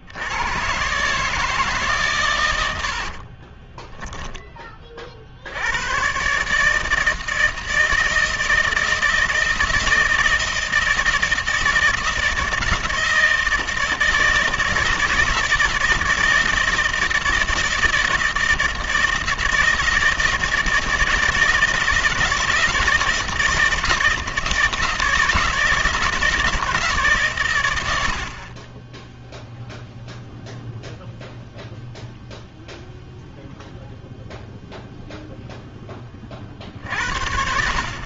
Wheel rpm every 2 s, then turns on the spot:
110, 80, 20, 150, 160, 160, 160, 160, 160, 160, 160, 160, 160, 160, 30, 0, 0, 0, 50.
2-4